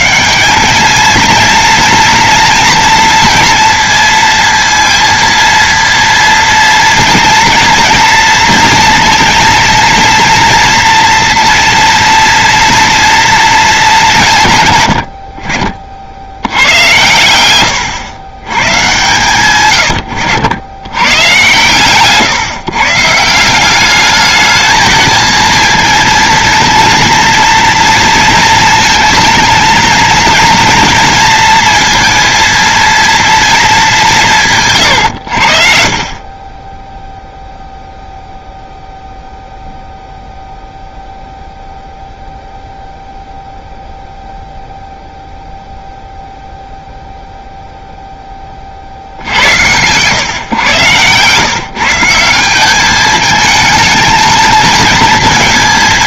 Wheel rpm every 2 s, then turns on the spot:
210, 240, 230, 230, 230, 230, 230, 90, 100, 130, 110, 140, 220, 230, 230, 240, 230, 150, 10, 0, 0, 0, 0, 0, 40, 120, 190, 220.
36-38